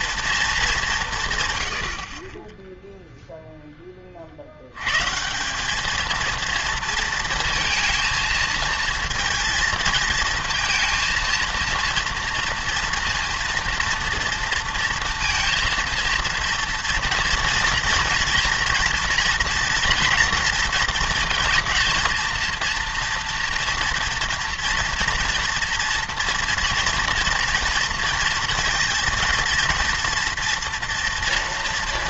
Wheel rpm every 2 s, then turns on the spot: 210, 10, 90, 230, 230, 230, 230, 230, 230, 230, 230, 230, 230, 230, 230, 230.
none